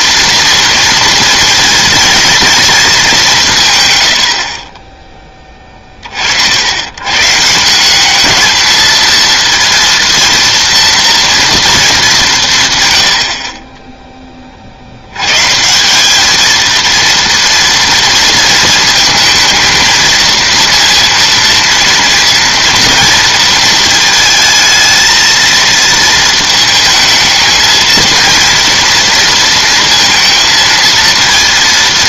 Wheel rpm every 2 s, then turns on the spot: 230, 210, 10, 110, 220, 230, 120, 40, 220, 230, 230, 230, 230, 220, 230, 230.
none